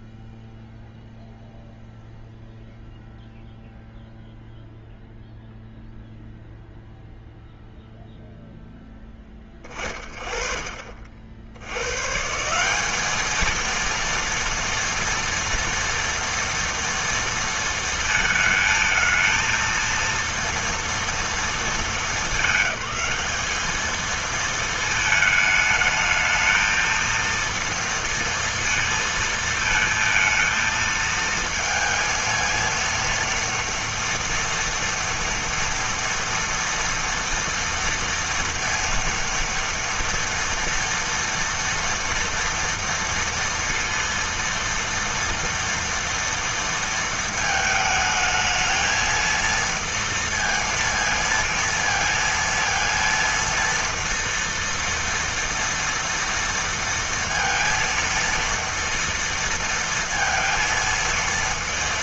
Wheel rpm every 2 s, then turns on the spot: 0, 0, 0, 0, 0, 40, 170, 230, 230, 220, 230, 210, 220, 220, 230, 230, 230, 230, 230, 230, 240, 230, 230, 230, 220, 230, 230, 230, 230, 230, 230.
none